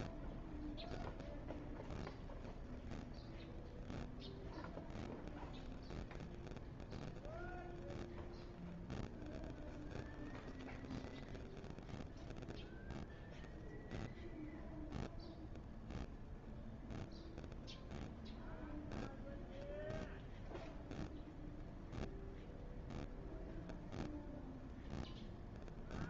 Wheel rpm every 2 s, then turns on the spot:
0, 0, 0, 0, 0, 0, 0, 0, 0, 0, 0, 0, 0.
none